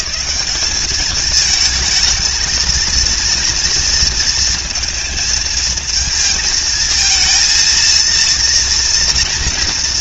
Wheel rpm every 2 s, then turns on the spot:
220, 220, 230, 220, 230.
none